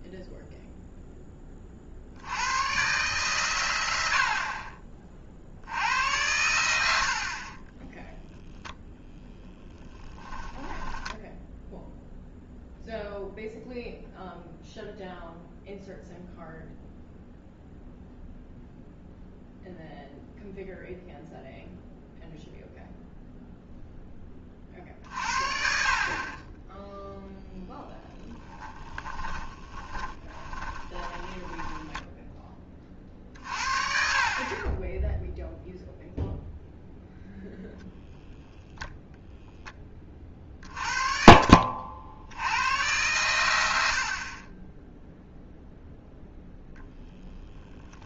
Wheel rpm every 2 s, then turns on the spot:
0, 110, 40, 80, 0, 10, 0, 0, 0, 0, 0, 0, 40, 10, 20, 20, 30, 30, 0, 10, 40, 100, 20, 0.
10-12 28-32